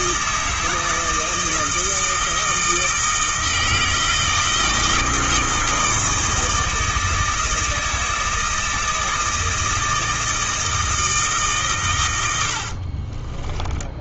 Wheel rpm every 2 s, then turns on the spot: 160, 160, 160, 160, 160, 160, 40.
12-14